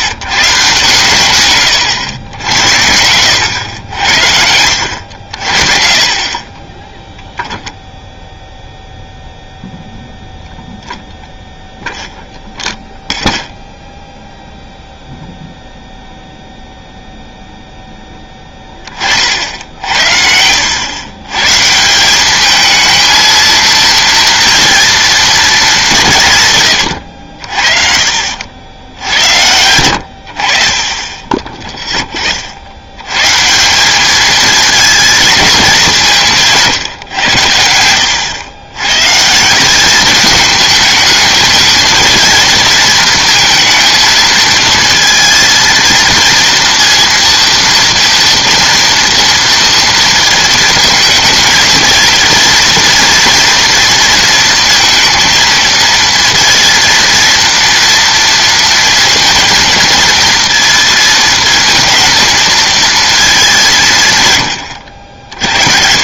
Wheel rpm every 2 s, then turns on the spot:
140, 90, 80, 20, 0, 0, 0, 0, 0, 10, 90, 210, 230, 130, 70, 60, 70, 220, 160, 100, 210, 230, 230, 230, 230, 220, 230, 230, 230, 230, 230, 230, 110.
6-8